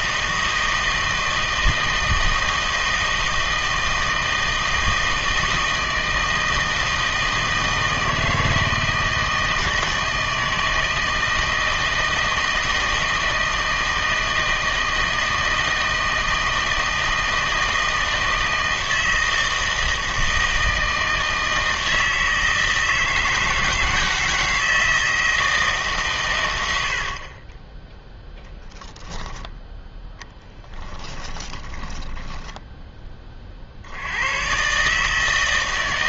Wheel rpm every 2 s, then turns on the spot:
160, 160, 160, 160, 160, 160, 160, 160, 160, 160, 160, 160, 160, 80, 10, 10, 10, 130.
26-28 30-34